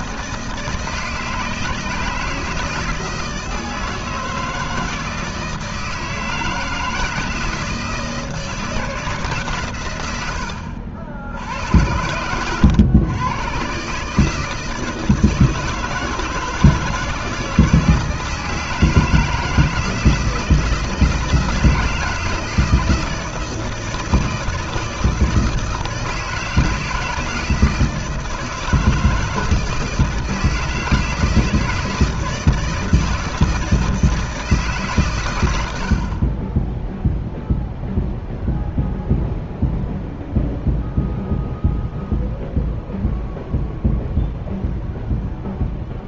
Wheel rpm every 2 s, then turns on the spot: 160, 160, 160, 160, 170, 70, 120, 160, 160, 160, 160, 160, 160, 160, 160, 160, 160, 140, 0, 0, 0, 0, 0.
none